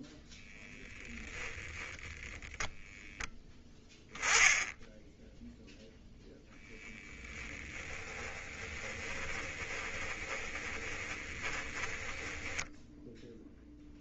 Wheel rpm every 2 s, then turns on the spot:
0, 10, 10, 10, 10, 20, 0.
8-12